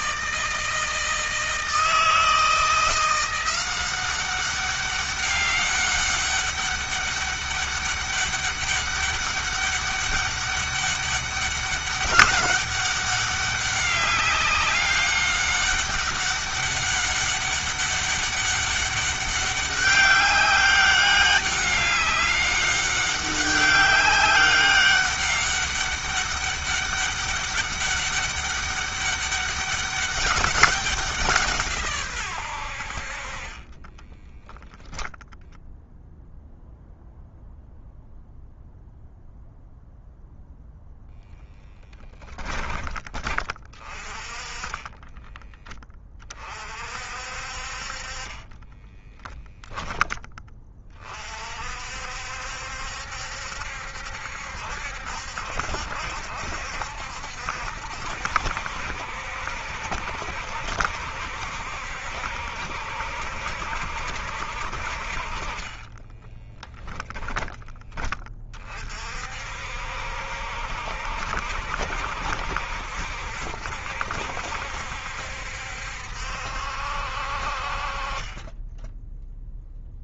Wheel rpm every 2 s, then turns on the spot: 160, 170, 190, 200, 200, 200, 200, 200, 200, 200, 200, 200, 200, 200, 200, 200, 100, 10, 0, 0, 0, 10, 20, 40, 20, 20, 70, 70, 70, 70, 70, 70, 60, 10, 30, 60, 60, 70, 70, 10.
34-36 44-46 48-50 66-68